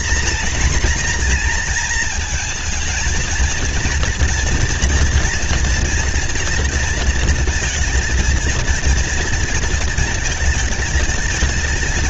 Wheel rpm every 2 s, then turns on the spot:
240, 230, 240, 230, 230, 220.
none